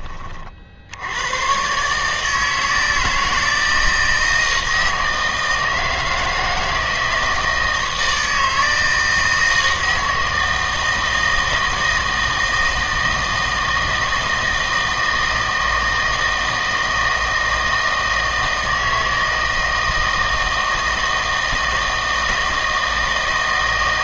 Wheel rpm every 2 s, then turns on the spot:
70, 160, 160, 160, 160, 160, 160, 160, 160, 160, 160, 160.
none